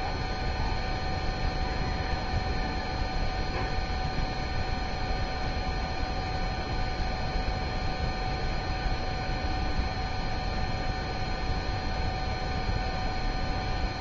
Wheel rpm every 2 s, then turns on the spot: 0, 0, 0, 0, 0, 0, 0.
none